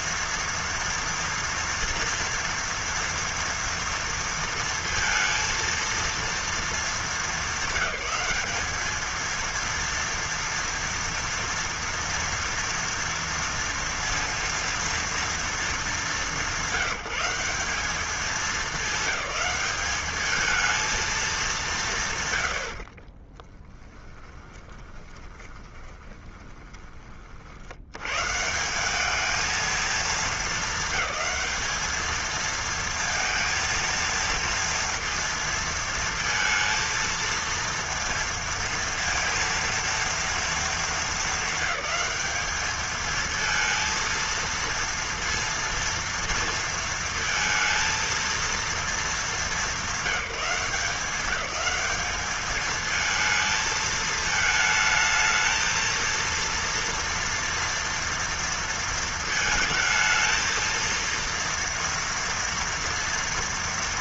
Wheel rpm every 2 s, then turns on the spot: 230, 230, 230, 230, 200, 230, 230, 230, 180, 210, 220, 120, 20, 20, 140, 220, 220, 230, 230, 230, 230, 200, 230, 230, 230, 190, 210, 220, 230, 230, 230, 230.
24-28